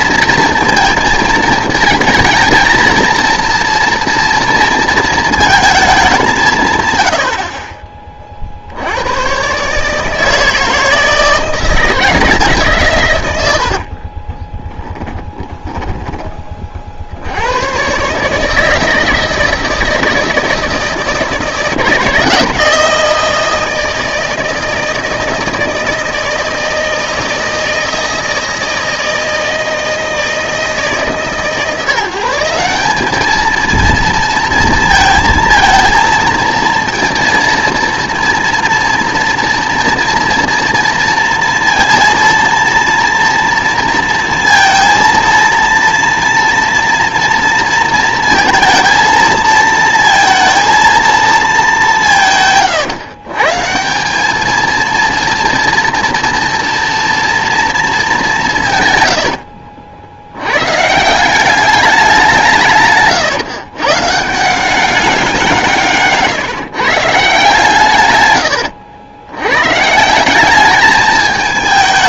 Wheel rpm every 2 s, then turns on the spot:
230, 230, 230, 140, 70, 160, 150, 10, 40, 160, 160, 160, 160, 160, 160, 160, 190, 230, 230, 230, 230, 240, 230, 230, 220, 230, 140, 220, 230, 140, 140, 150, 190, 140, 90, 210.
14-16